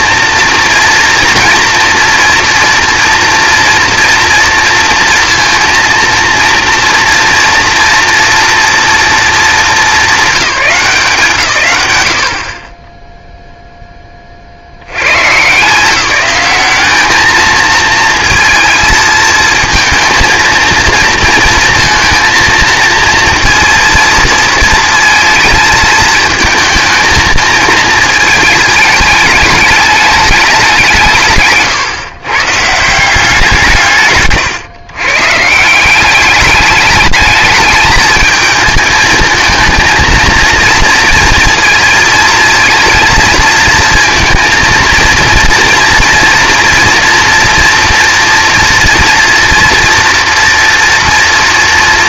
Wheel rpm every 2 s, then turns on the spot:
230, 230, 230, 230, 230, 180, 20, 100, 210, 220, 230, 230, 230, 220, 210, 170, 170, 130, 210, 220, 230, 230, 230, 230, 240, 230.
none